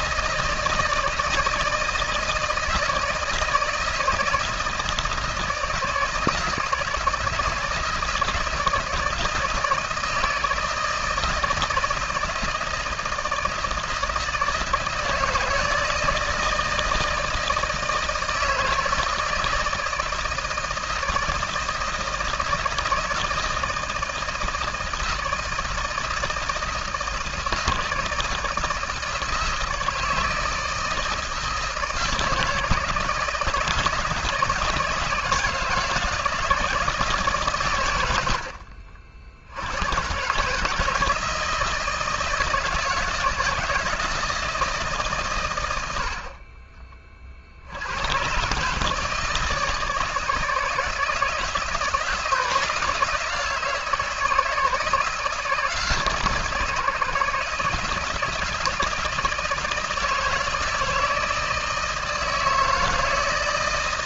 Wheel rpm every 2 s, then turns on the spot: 160, 160, 160, 160, 160, 160, 160, 160, 160, 160, 160, 160, 160, 160, 160, 160, 160, 160, 160, 60, 150, 160, 160, 30, 140, 160, 160, 160, 160, 160, 160, 160.
none